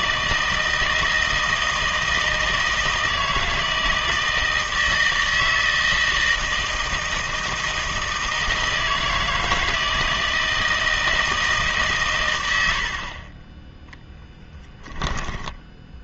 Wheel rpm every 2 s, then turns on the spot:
160, 160, 160, 160, 160, 160, 80, 10.
none